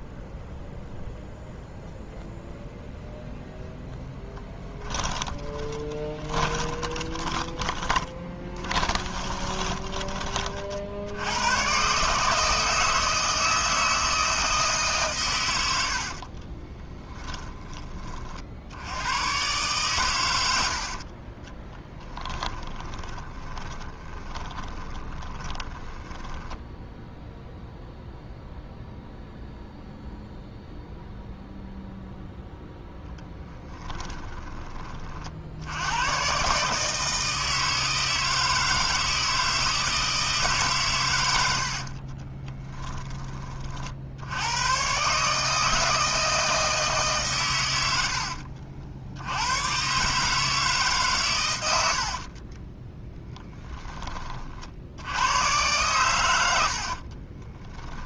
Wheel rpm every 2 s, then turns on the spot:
0, 0, 10, 20, 20, 70, 160, 150, 20, 90, 50, 20, 10, 10, 0, 0, 0, 30, 150, 160, 130, 10, 120, 160, 70, 140, 10, 60, 60.
4-10 16-18 22-26 56-58